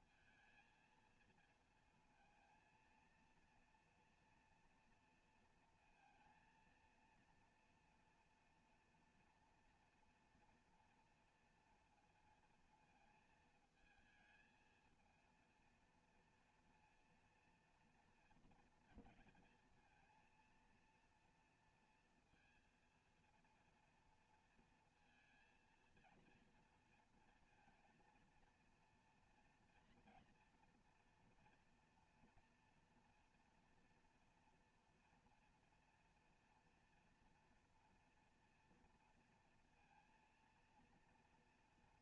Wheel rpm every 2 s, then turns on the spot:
230, 230, 230, 230, 240, 230, 230, 230, 230, 230, 230, 230, 230, 230, 240, 240, 230, 240, 230, 240, 230.
none